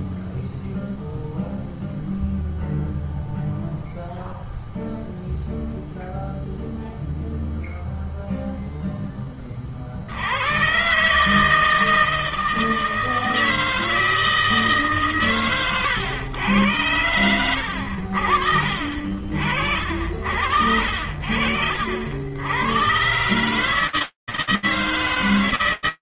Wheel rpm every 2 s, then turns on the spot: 0, 0, 0, 0, 10, 150, 160, 140, 90, 50, 50, 140, 140.
none